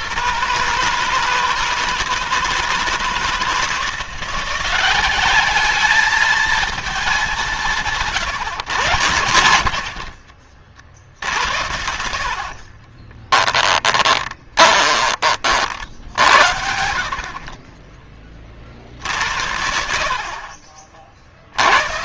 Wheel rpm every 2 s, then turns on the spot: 150, 160, 190, 220, 150, 60, 30, 20, 60, 50, 50.
8-10 12-16 20-22